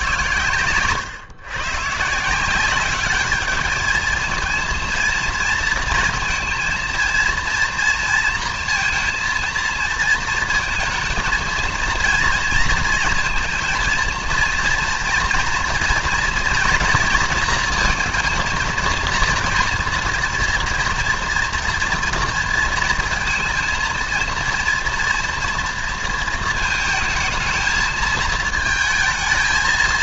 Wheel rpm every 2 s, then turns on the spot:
110, 190, 230, 220, 230, 220, 230, 230, 230, 230, 230, 230, 230, 220, 220.
none